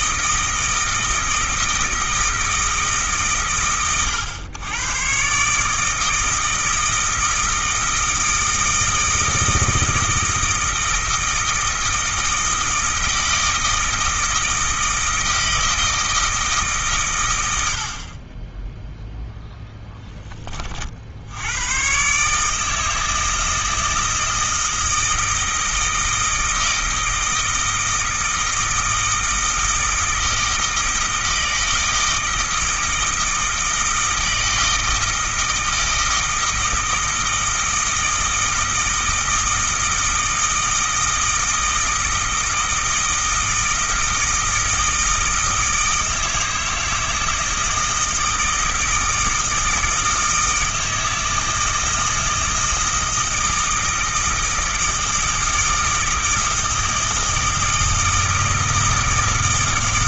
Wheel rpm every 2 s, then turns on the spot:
160, 160, 110, 160, 160, 160, 160, 160, 160, 10, 30, 150, 160, 160, 160, 160, 160, 160, 160, 160, 160, 160, 160, 160, 160, 160, 160, 160, 160, 160.
none